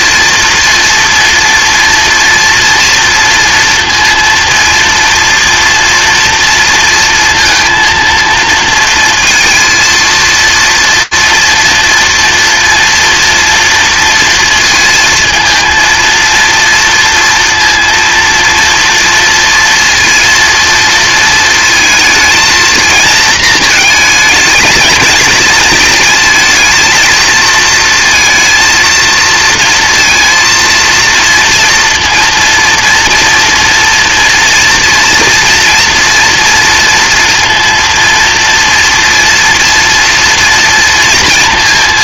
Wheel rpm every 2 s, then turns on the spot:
230, 230, 230, 230, 230, 230, 230, 230, 230, 230, 230, 230, 220, 220, 230, 230, 230, 240, 230, 230, 230.
none